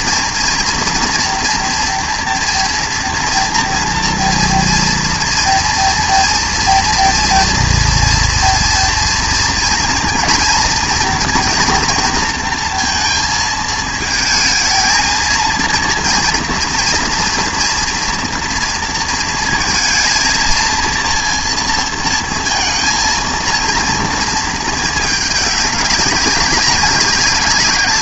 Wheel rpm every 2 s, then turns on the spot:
230, 230, 230, 230, 230, 230, 230, 220, 230, 230, 230, 230, 220, 190.
none